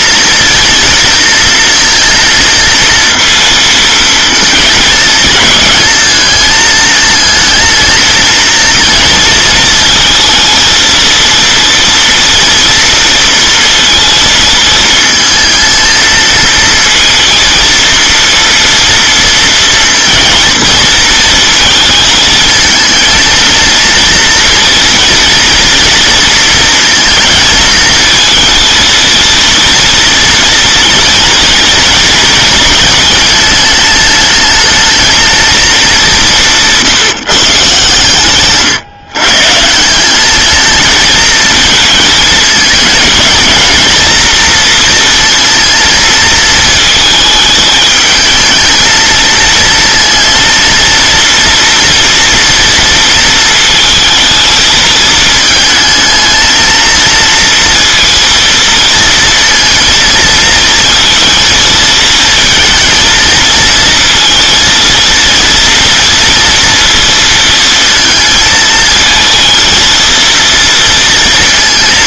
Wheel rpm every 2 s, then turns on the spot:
230, 230, 230, 220, 230, 230, 230, 220, 230, 230, 230, 220, 230, 230, 230, 230, 220, 220, 180, 140, 220, 210, 230, 220, 220, 230, 230, 230, 230, 230, 230, 230, 230, 230, 220, 230.
none